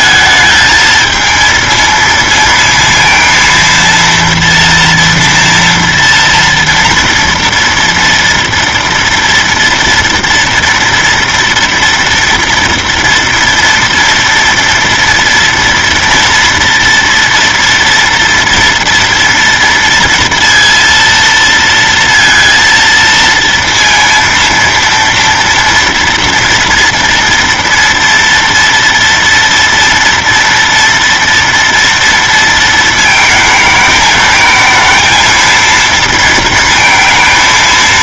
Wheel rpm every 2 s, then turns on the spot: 220, 230, 230, 230, 230, 230, 230, 230, 230, 240, 230, 230, 230, 230, 230, 230, 230, 220, 220.
none